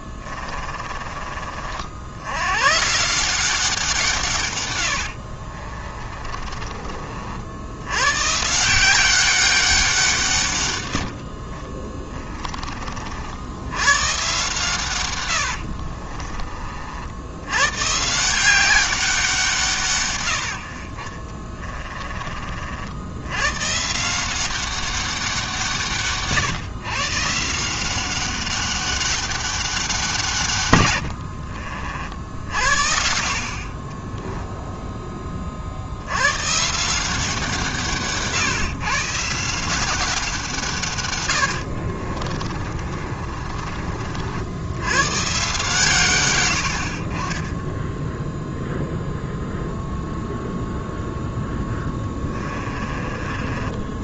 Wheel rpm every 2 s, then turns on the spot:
30, 120, 110, 30, 160, 130, 30, 130, 40, 190, 70, 40, 190, 150, 200, 120, 60, 10, 140, 140, 160, 30, 80, 80, 0, 0, 30.
0-2 6-8 42-44 52-54